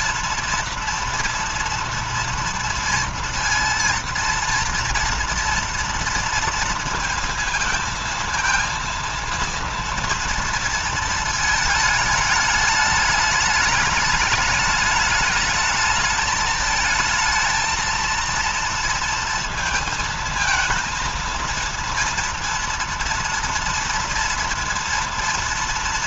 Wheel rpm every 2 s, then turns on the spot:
230, 230, 230, 230, 230, 230, 210, 210, 220, 230, 230, 230, 230.
none